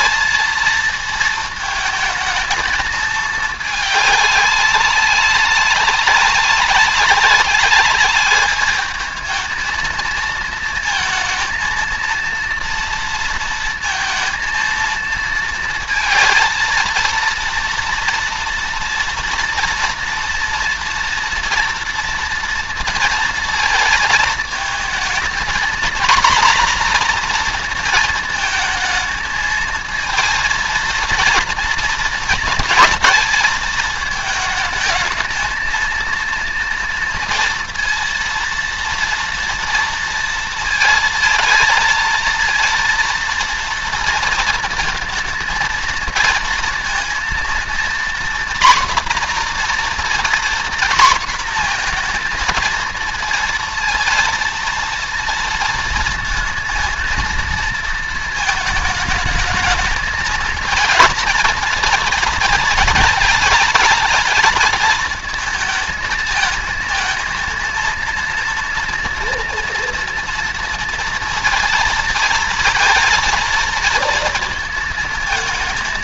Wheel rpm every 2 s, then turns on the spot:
220, 220, 200, 190, 210, 230, 230, 230, 230, 240, 230, 230, 220, 240, 220, 230, 220, 220, 230, 230, 230, 230, 230, 230, 240, 240, 230, 230, 230, 220, 230, 210, 220, 220, 230, 230, 230, 230.
none